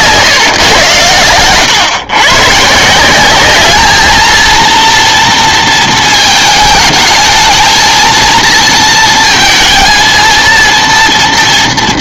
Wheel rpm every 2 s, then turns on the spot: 130, 140, 230, 220, 230, 230.
none